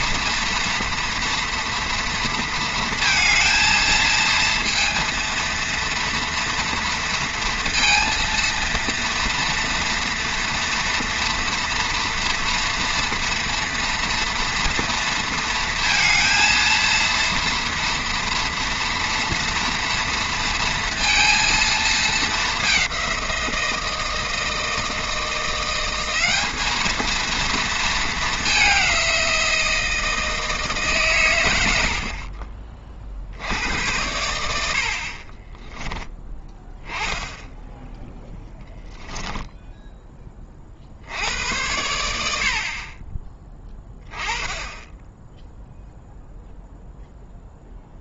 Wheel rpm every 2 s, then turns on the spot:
230, 230, 230, 230, 230, 230, 230, 230, 230, 230, 230, 200, 160, 220, 190, 150, 40, 70, 10, 10, 40, 50, 10, 0.
38-40